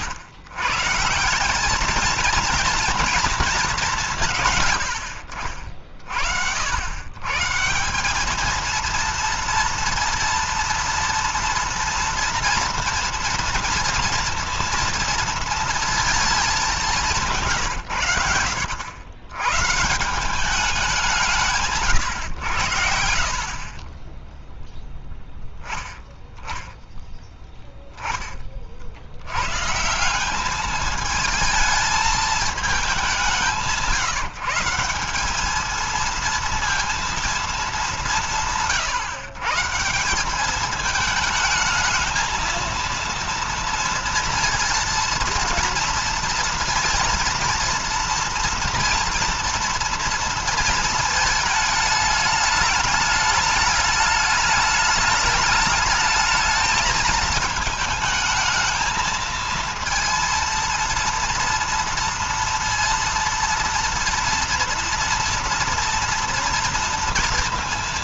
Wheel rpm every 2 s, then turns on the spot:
130, 220, 110, 90, 220, 230, 230, 230, 210, 100, 200, 110, 10, 10, 40, 210, 210, 180, 230, 150, 210, 230, 230, 230, 230, 230, 210, 210, 220, 220, 230, 230, 230, 230.
none